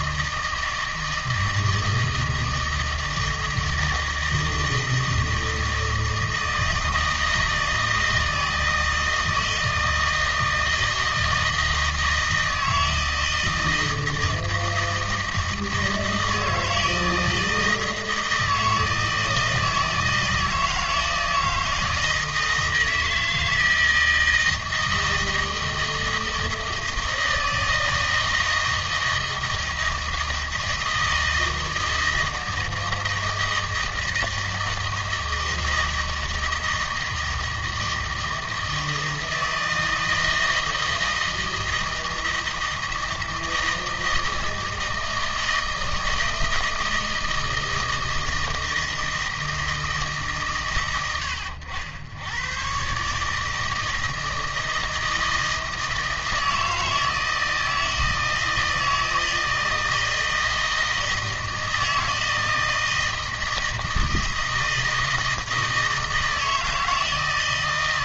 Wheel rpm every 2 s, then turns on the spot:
160, 160, 160, 160, 160, 160, 160, 160, 160, 160, 160, 160, 160, 160, 160, 160, 160, 160, 160, 160, 160, 160, 160, 160, 160, 120, 130, 160, 160, 160, 160, 160, 160, 160.
none